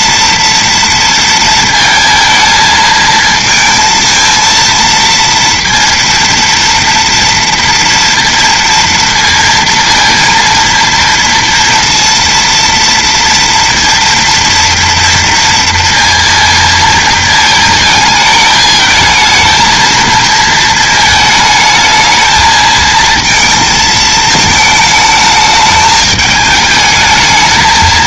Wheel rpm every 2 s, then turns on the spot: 230, 220, 230, 230, 230, 230, 230, 230, 230, 220, 220, 220, 220, 220.
none